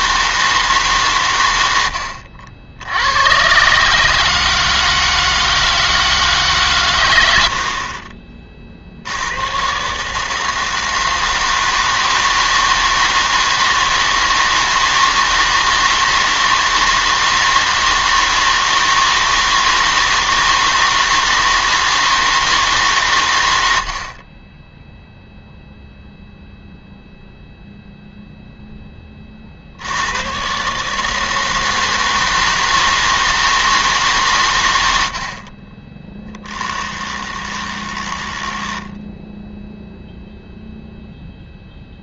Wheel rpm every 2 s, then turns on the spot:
150, 80, 160, 140, 50, 160, 160, 160, 160, 160, 160, 140, 10, 0, 10, 140, 160, 90, 10, 10, 0.
36-40